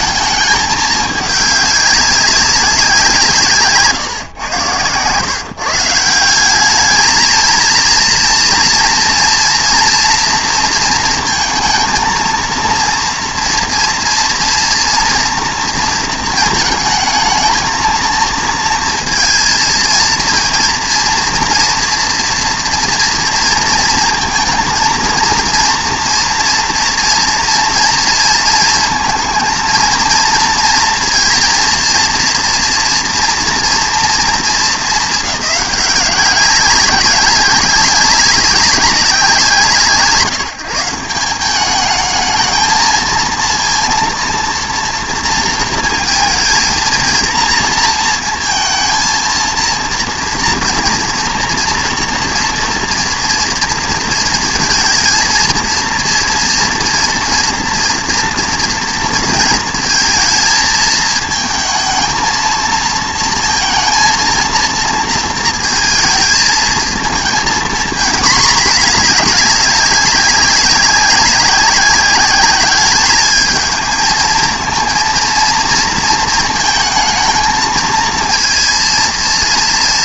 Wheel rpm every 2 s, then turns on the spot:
210, 190, 120, 200, 230, 230, 230, 230, 220, 230, 230, 230, 230, 230, 230, 230, 230, 210, 190, 190, 170, 220, 230, 230, 230, 230, 230, 230, 230, 230, 220, 230, 230, 220, 220, 200, 200, 230, 230, 230.
none